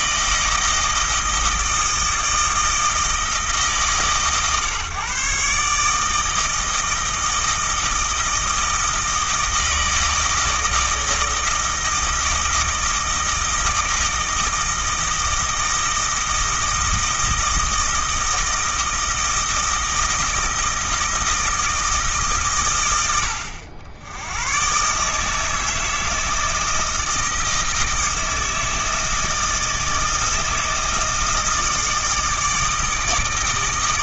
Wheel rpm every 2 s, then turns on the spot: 160, 160, 130, 160, 160, 160, 160, 160, 160, 160, 160, 100, 140, 160, 160, 160, 160.
none